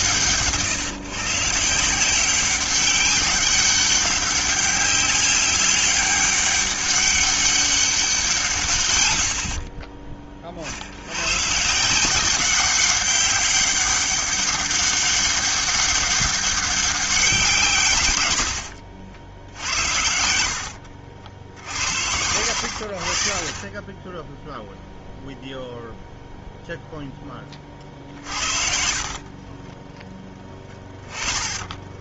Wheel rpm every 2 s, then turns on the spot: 140, 190, 190, 200, 150, 40, 190, 200, 200, 90, 70, 70, 0, 0, 50, 20.
18-22 28-30